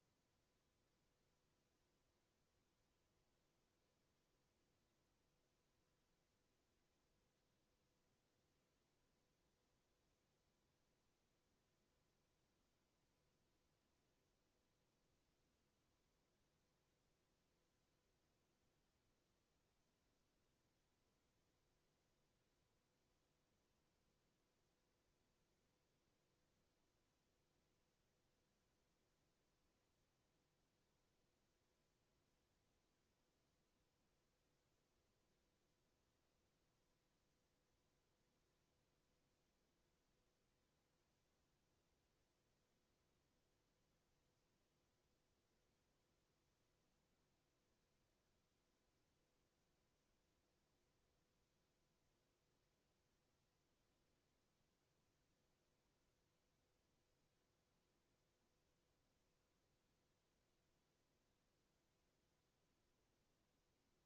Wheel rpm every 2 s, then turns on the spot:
0, 0, 0, 0, 0, 0, 0, 0, 0, 0, 0, 0, 0, 0, 0, 0, 0, 0, 0, 0, 0, 0, 0, 0, 0, 0, 0, 0, 0, 0, 0, 0.
none